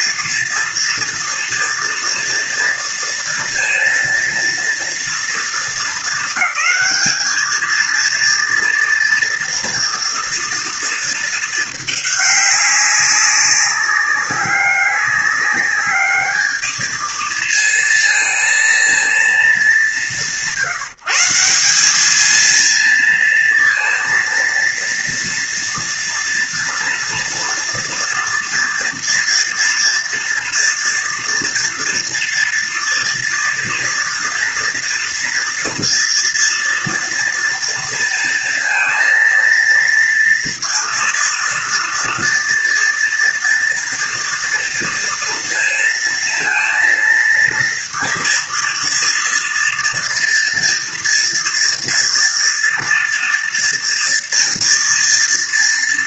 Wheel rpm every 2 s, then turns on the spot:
230, 230, 230, 220, 230, 230, 200, 200, 210, 230, 160, 220, 230, 230, 230, 230, 230, 230, 230, 230, 230, 230, 230, 230, 230, 230, 230, 230.
none